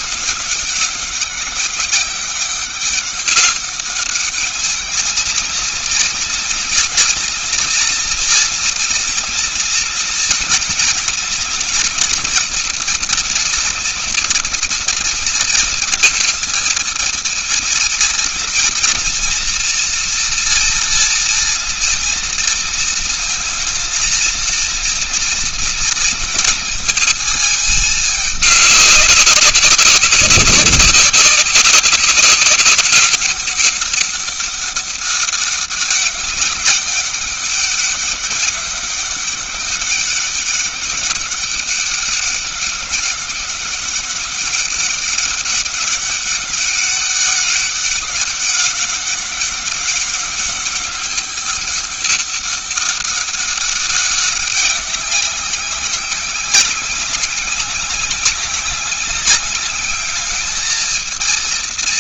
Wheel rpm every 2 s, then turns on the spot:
200, 190, 210, 230, 240, 230, 240, 230, 230, 230, 240, 230, 230, 230, 210, 200, 200, 200, 190, 200, 200, 200, 200, 200, 200, 190, 200, 200, 190, 190, 210.
none